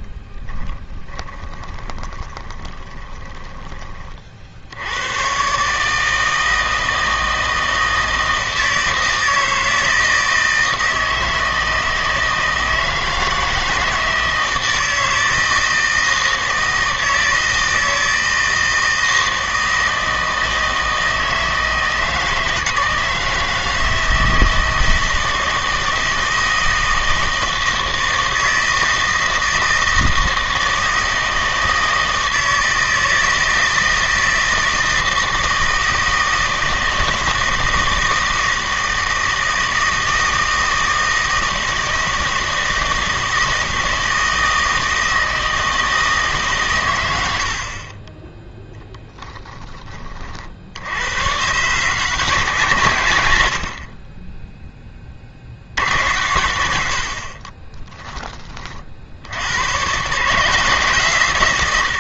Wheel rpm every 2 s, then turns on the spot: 20, 20, 70, 160, 160, 160, 160, 160, 160, 160, 160, 160, 160, 160, 160, 160, 160, 160, 160, 160, 160, 160, 160, 120, 0, 70, 140, 20, 90, 30, 160.
0-4